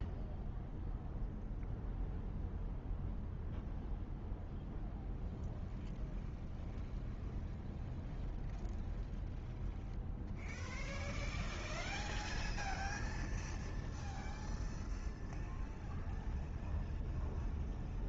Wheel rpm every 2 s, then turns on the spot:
0, 0, 0, 0, 0, 0, 0, 0, 0.
none